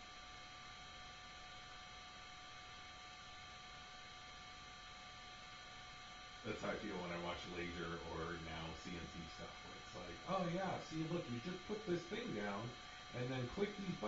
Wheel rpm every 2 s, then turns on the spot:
0, 0, 0, 0, 0, 0, 0.
none